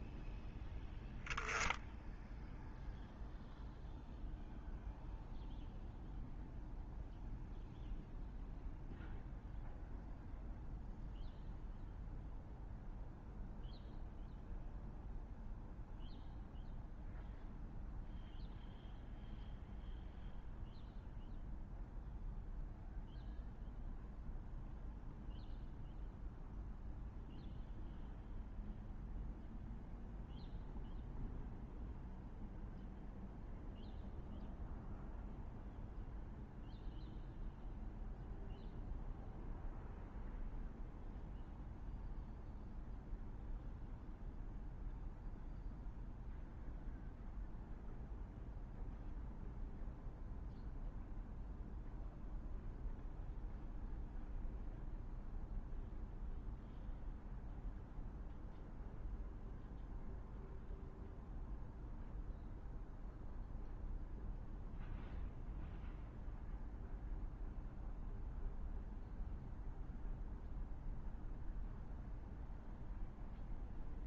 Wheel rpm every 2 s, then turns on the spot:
0, 0, 0, 0, 0, 0, 0, 0, 0, 0, 0, 0, 0, 0, 0, 0, 0, 0, 0, 0, 0, 0, 0, 0, 0, 0, 0, 0, 0, 0, 0, 0, 0, 0, 0, 0, 0.
none